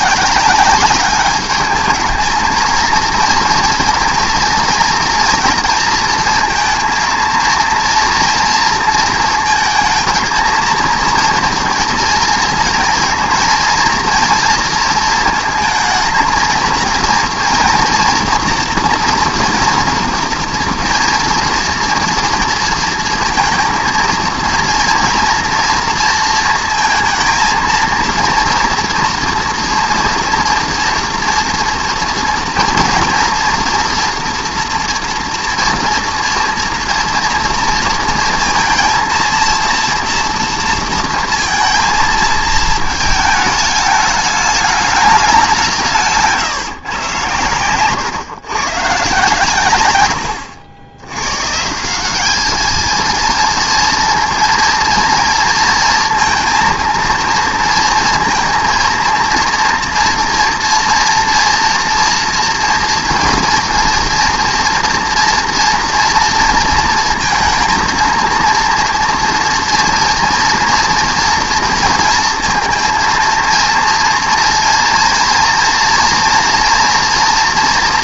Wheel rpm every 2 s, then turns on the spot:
190, 220, 230, 230, 230, 220, 230, 230, 230, 230, 230, 230, 230, 220, 230, 240, 230, 230, 230, 230, 230, 220, 210, 140, 120, 80, 220, 230, 230, 230, 230, 230, 230, 230, 230, 230, 230, 230, 240.
none